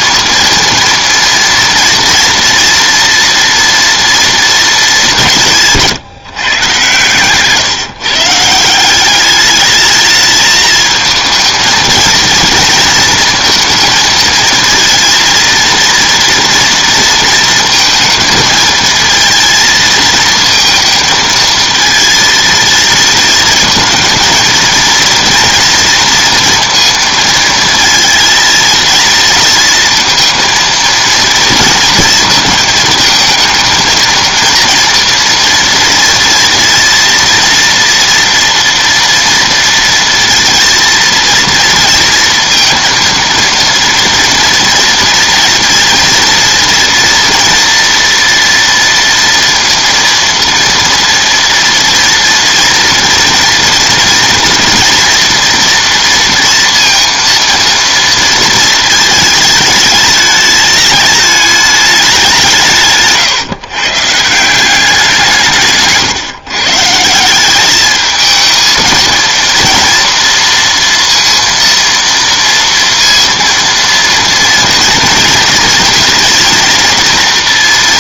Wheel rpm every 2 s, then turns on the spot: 230, 230, 210, 130, 190, 220, 230, 230, 230, 220, 230, 230, 230, 230, 230, 230, 220, 230, 230, 230, 230, 230, 230, 230, 230, 230, 240, 230, 230, 220, 210, 150, 180, 160, 230, 230, 230, 230, 230.
none